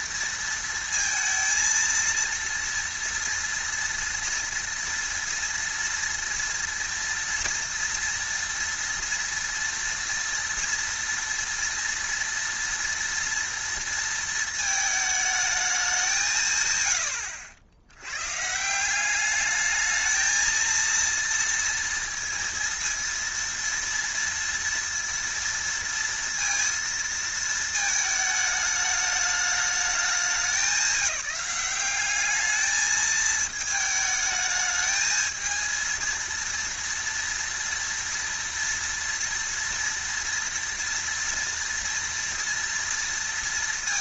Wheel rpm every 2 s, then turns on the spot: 230, 230, 230, 230, 230, 230, 230, 220, 100, 180, 230, 230, 230, 230, 210, 190, 220, 220, 230, 230, 230, 230.
none